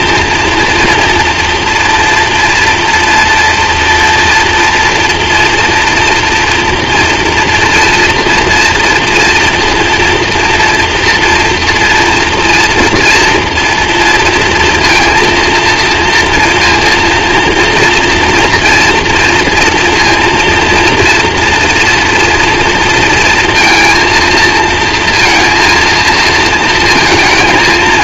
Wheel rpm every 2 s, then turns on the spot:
230, 230, 230, 230, 230, 230, 240, 230, 230, 230, 230, 230, 230, 220.
none